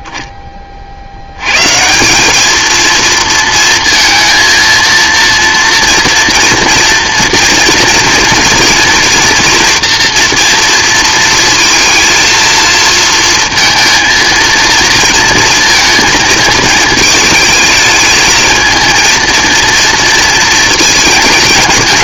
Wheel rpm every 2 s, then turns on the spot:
10, 210, 230, 230, 230, 230, 230, 230, 230, 220, 230.
none